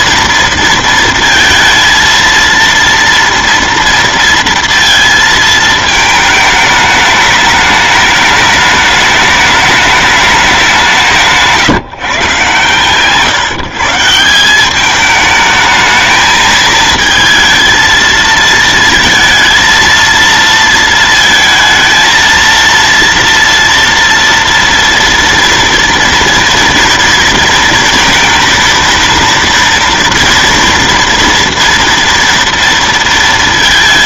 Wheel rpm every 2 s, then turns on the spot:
230, 230, 230, 210, 210, 190, 130, 200, 220, 230, 230, 230, 230, 230, 230, 230, 230.
12-14